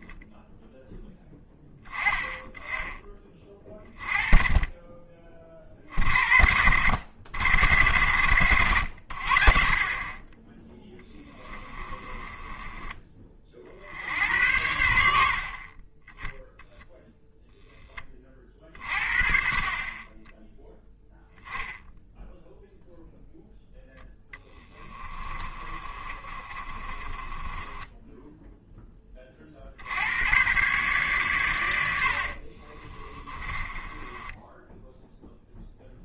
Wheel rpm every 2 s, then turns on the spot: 0, 20, 20, 80, 90, 10, 20, 70, 0, 40, 0, 0, 10, 30, 10, 130, 40, 10.
12-14 24-28 32-36